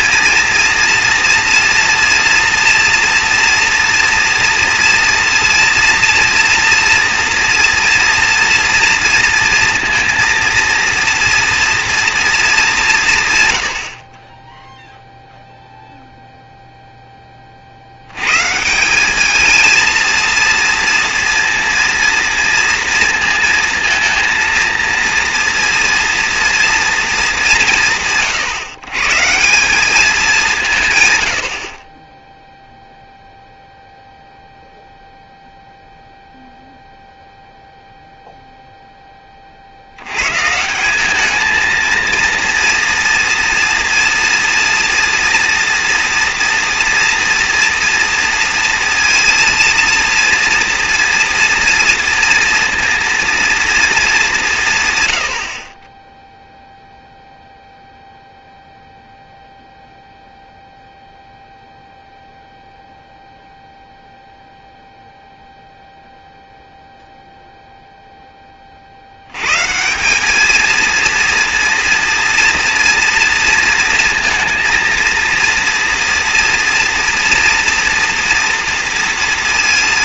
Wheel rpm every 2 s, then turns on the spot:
230, 230, 230, 230, 230, 230, 220, 20, 0, 140, 230, 230, 230, 230, 140, 170, 0, 0, 0, 0, 150, 230, 230, 240, 230, 230, 230, 180, 0, 0, 0, 0, 0, 0, 20, 220, 230, 230, 240, 230.
none